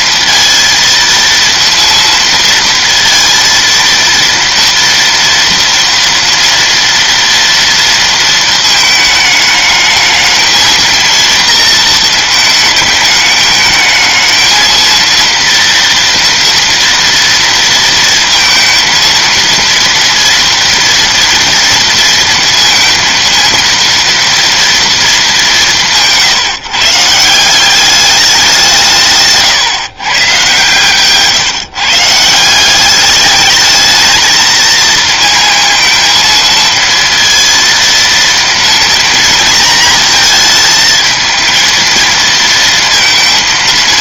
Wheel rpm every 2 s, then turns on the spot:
230, 230, 230, 230, 220, 230, 220, 230, 230, 230, 230, 230, 230, 150, 170, 130, 180, 230, 230, 230, 220, 230.
none